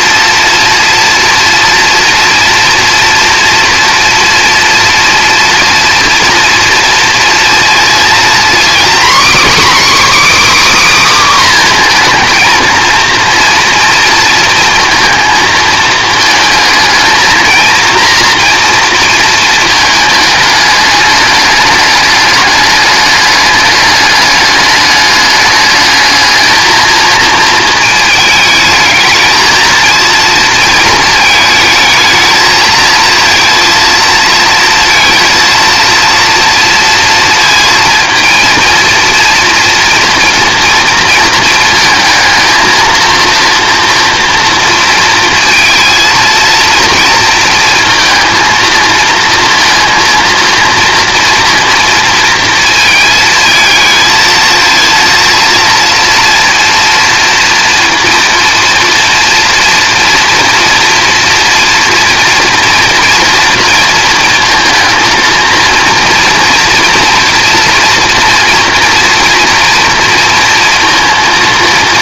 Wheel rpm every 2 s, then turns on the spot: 230, 230, 230, 230, 250, 300, 230, 230, 220, 230, 210, 210, 210, 220, 220, 230, 220, 230, 230, 230, 230, 230, 230, 230, 220, 230, 220, 220, 230, 230, 230, 230, 230, 230, 240, 230.
none